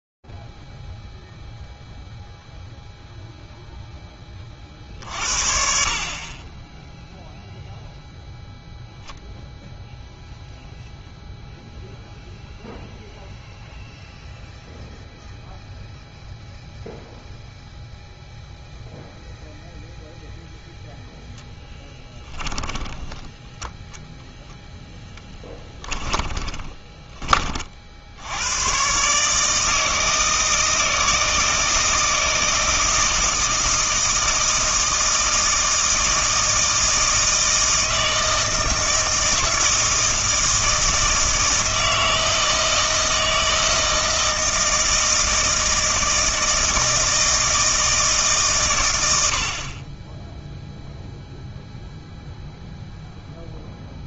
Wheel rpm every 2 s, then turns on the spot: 0, 0, 30, 30, 0, 0, 0, 0, 0, 0, 0, 10, 0, 20, 110, 160, 160, 160, 160, 160, 160, 160, 160, 160, 120, 0, 0.
22-24 26-28